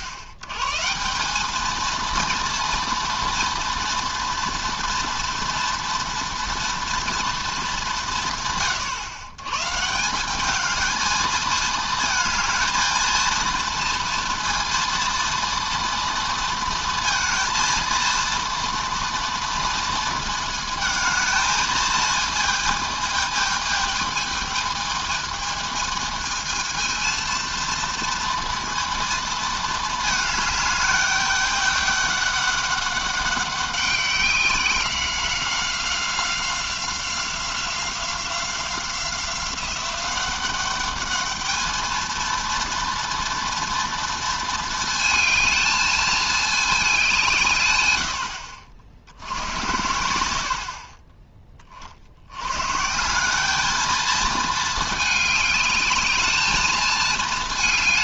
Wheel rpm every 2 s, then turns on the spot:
110, 230, 230, 230, 130, 210, 220, 230, 230, 230, 220, 230, 220, 220, 230, 210, 200, 190, 190, 180, 200, 230, 220, 210, 60, 50, 130, 220, 220.
none